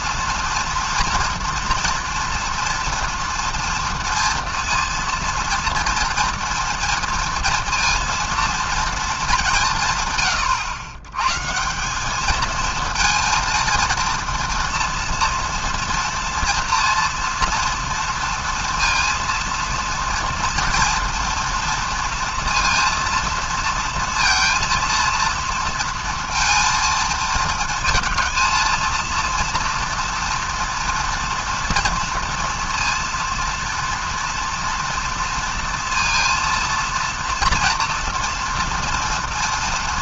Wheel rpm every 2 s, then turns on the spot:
240, 240, 230, 230, 230, 120, 220, 230, 230, 230, 230, 230, 230, 230, 220, 240, 230, 230, 230, 230.
none